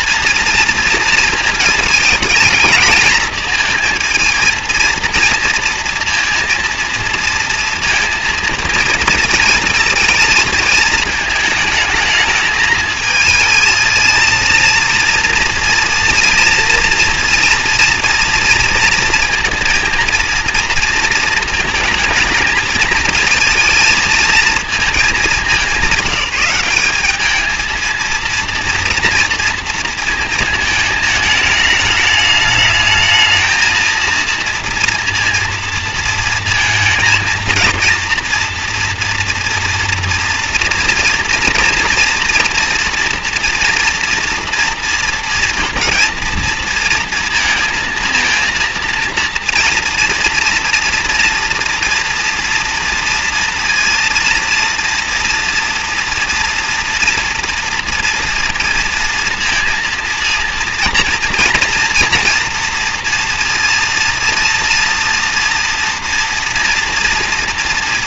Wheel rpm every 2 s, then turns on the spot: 230, 220, 230, 230, 230, 220, 220, 230, 230, 230, 230, 220, 220, 190, 230, 220, 210, 230, 220, 230, 230, 240, 230, 230, 230, 230, 230, 230, 240, 230, 230, 240, 230, 230.
none